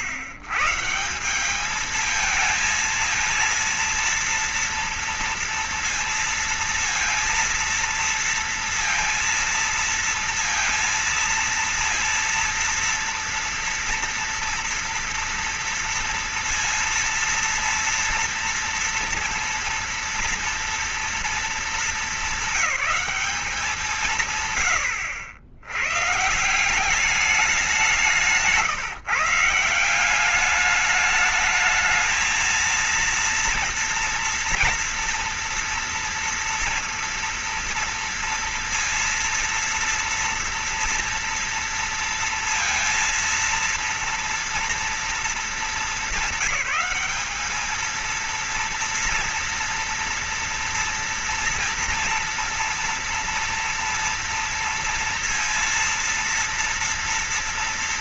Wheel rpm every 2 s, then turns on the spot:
110, 220, 230, 230, 230, 230, 230, 230, 230, 230, 230, 210, 130, 150, 160, 190, 220, 240, 230, 230, 230, 230, 230, 200, 230, 230, 230, 230, 230.
none